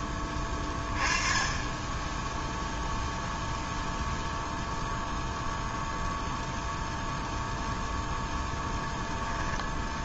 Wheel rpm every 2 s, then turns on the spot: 10, 0, 0, 0, 0.
none